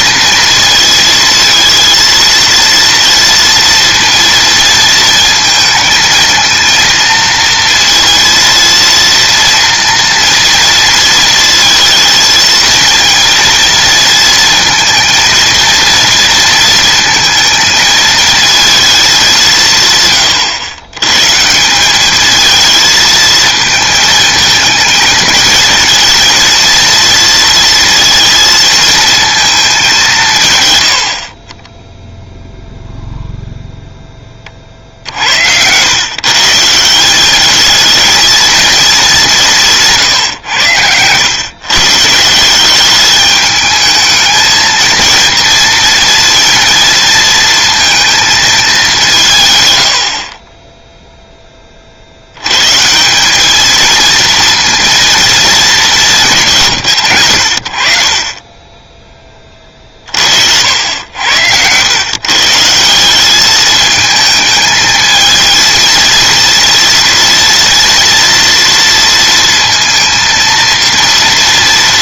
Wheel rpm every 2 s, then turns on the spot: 230, 230, 230, 230, 230, 230, 220, 220, 230, 210, 100, 220, 220, 230, 230, 90, 0, 50, 170, 210, 100, 200, 230, 230, 200, 0, 150, 230, 130, 20, 80, 170, 220, 230, 230, 230.
none